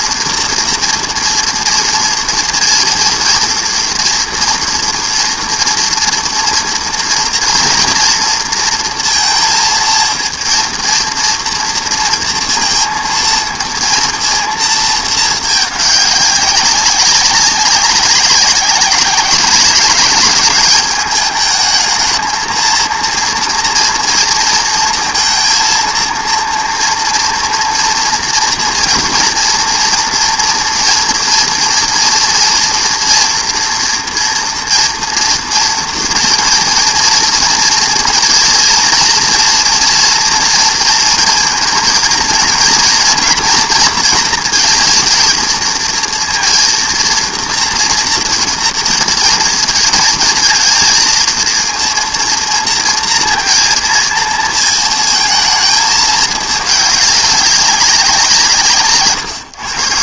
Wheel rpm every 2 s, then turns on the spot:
240, 230, 230, 230, 230, 230, 230, 230, 200, 190, 200, 220, 230, 230, 230, 230, 230, 230, 240, 230, 230, 230, 230, 230, 230, 230, 230, 230, 210, 180.
none